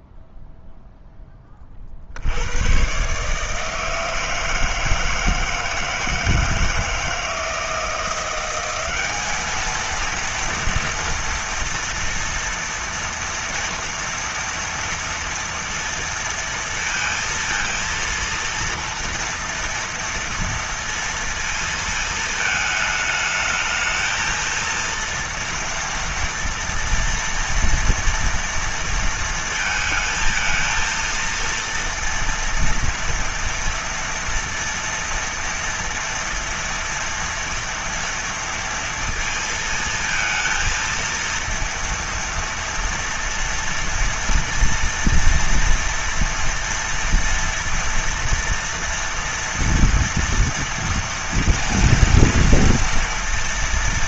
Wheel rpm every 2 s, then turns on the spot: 0, 80, 160, 160, 180, 230, 230, 230, 230, 230, 230, 220, 230, 230, 230, 220, 230, 230, 230, 230, 230, 230, 230, 230, 230, 230, 230.
none